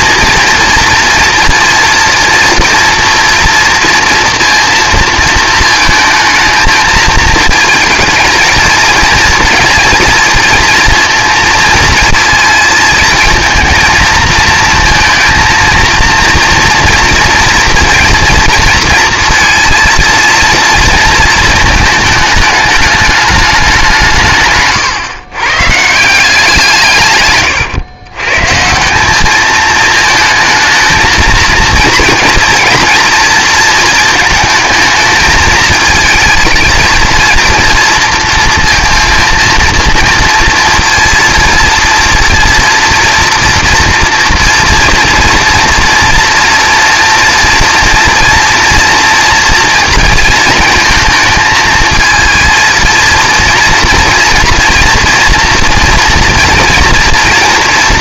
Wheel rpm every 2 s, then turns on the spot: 230, 230, 230, 220, 220, 230, 230, 230, 230, 230, 230, 210, 140, 160, 160, 230, 230, 220, 220, 230, 230, 230, 230, 230, 230, 230, 230, 230, 230.
none